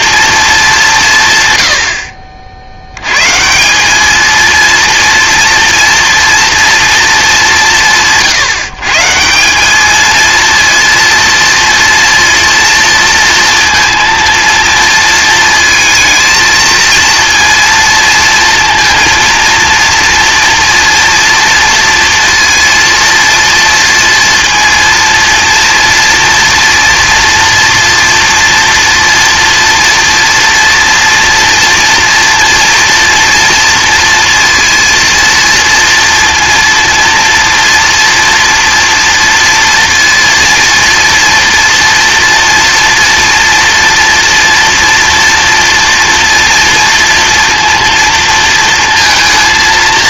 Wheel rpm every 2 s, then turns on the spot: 200, 60, 220, 230, 140, 230, 230, 230, 230, 230, 230, 230, 230, 240, 230, 230, 240, 230, 230, 230, 230, 230, 230, 230, 230.
none